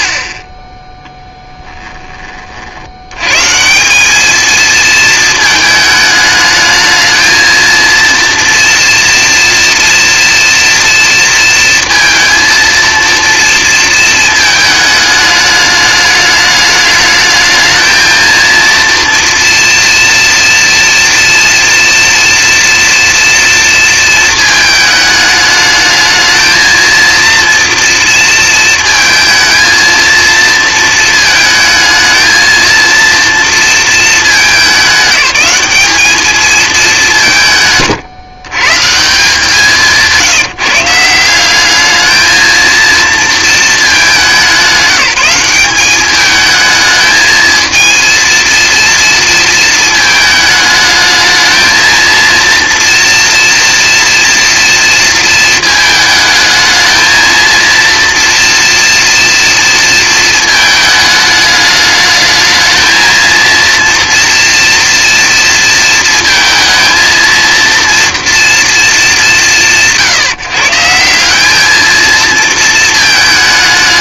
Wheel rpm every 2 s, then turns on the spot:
10, 50, 230, 220, 230, 230, 230, 220, 210, 230, 230, 240, 220, 220, 230, 230, 230, 210, 210, 130, 180, 230, 190, 210, 230, 220, 230, 230, 220, 230, 220, 220, 230, 230, 230, 160, 230.
none